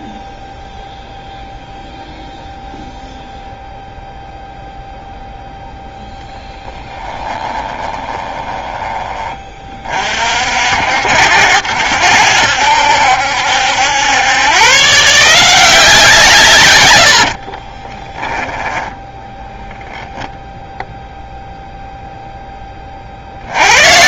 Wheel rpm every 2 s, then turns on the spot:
0, 0, 0, 10, 20, 60, 70, 140, 110, 10, 0, 30.
6-8 18-20